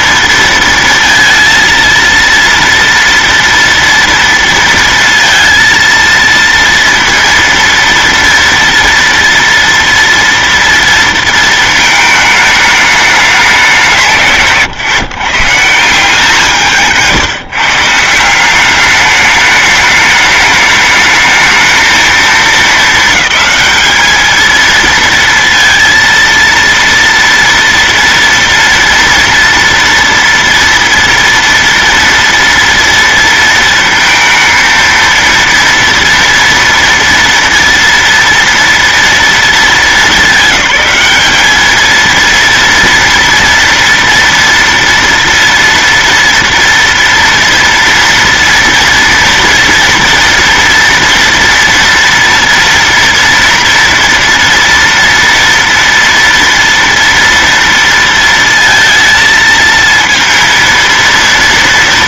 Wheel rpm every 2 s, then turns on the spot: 230, 230, 230, 230, 230, 230, 210, 140, 160, 210, 210, 220, 230, 230, 230, 230, 230, 230, 230, 230, 210, 230, 230, 230, 230, 230, 230, 230, 230, 230, 230.
16-18